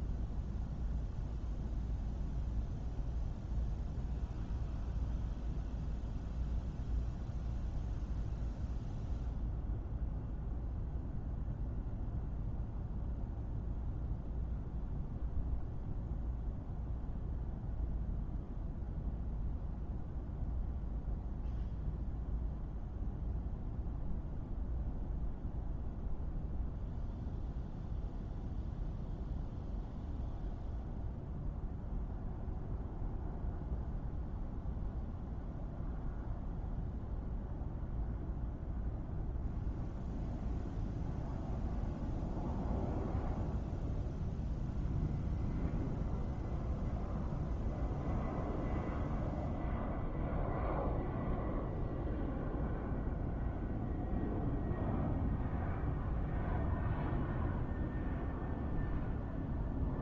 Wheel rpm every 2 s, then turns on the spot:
0, 0, 0, 0, 0, 0, 0, 0, 0, 0, 0, 0, 0, 0, 0, 0, 0, 0, 0, 0, 0, 0, 0, 0, 0, 0, 0, 0, 0, 0.
none